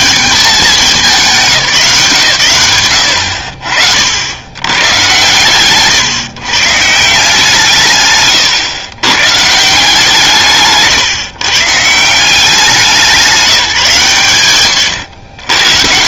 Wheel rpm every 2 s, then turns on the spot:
200, 110, 110, 140, 130, 160, 190, 130.
none